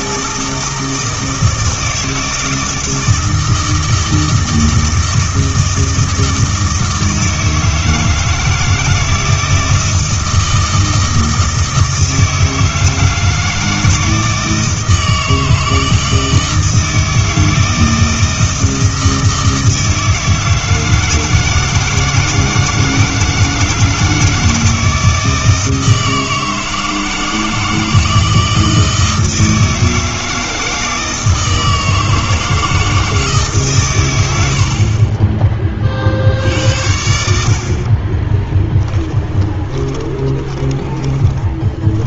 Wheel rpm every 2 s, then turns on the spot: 160, 160, 160, 160, 160, 160, 160, 160, 160, 160, 160, 160, 160, 160, 160, 160, 160, 70, 70, 10, 20.
34-36 40-42